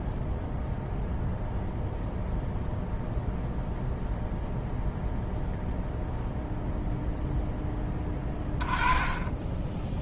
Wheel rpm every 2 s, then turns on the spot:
0, 0, 0, 0, 10.
8-10